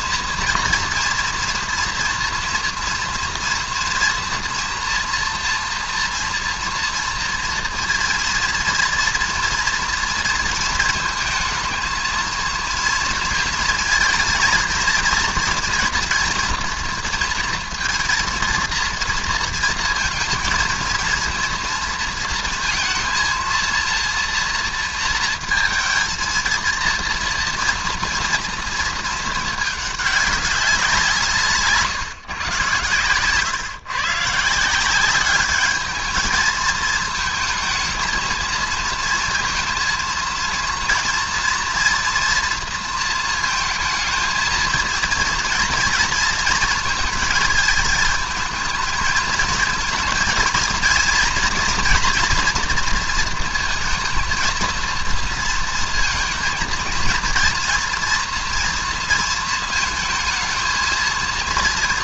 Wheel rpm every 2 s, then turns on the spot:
230, 230, 230, 230, 230, 230, 230, 230, 240, 230, 230, 230, 230, 230, 230, 200, 130, 150, 220, 230, 230, 240, 230, 230, 220, 230, 240, 230, 230, 240, 220.
none